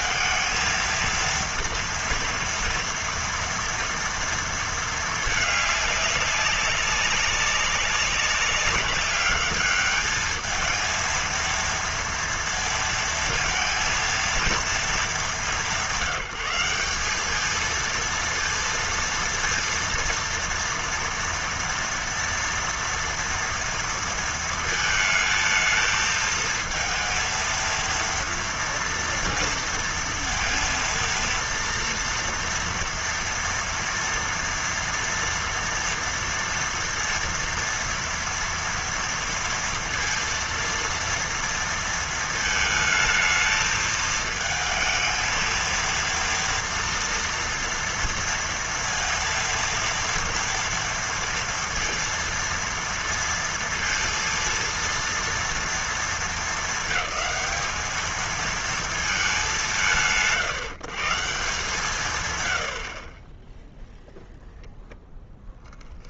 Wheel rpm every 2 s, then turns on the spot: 220, 230, 230, 200, 200, 220, 230, 230, 180, 230, 230, 230, 230, 220, 230, 230, 230, 230, 230, 230, 230, 220, 220, 230, 230, 230, 230, 230, 220, 220, 140, 110, 0.
none